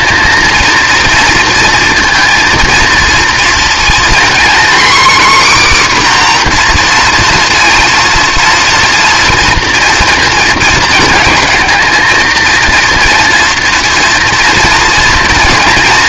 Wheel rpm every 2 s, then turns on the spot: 230, 230, 260, 250, 230, 230, 230, 230.
none